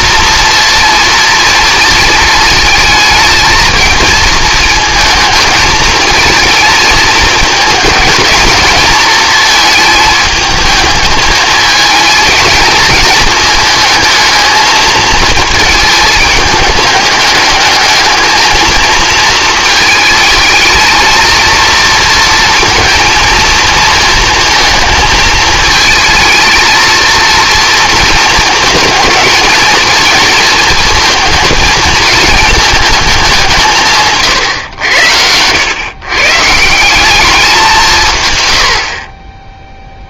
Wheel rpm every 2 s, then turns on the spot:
230, 220, 220, 220, 220, 220, 220, 220, 210, 220, 230, 230, 220, 230, 220, 230, 220, 100, 180, 80.
none